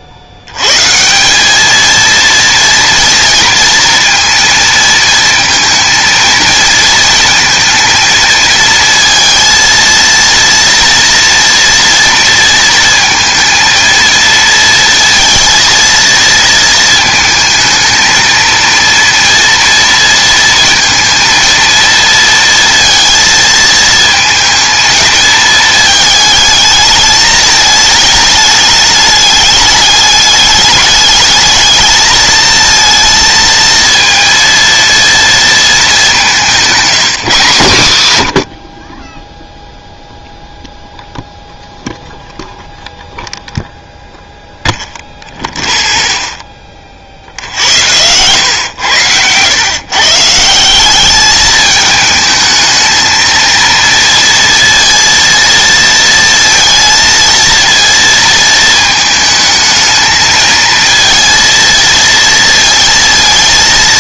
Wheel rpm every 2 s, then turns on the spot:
150, 230, 230, 230, 220, 230, 230, 230, 220, 230, 230, 230, 220, 220, 210, 210, 230, 230, 190, 40, 0, 0, 0, 40, 110, 200, 220, 230, 230, 220, 230, 230.
none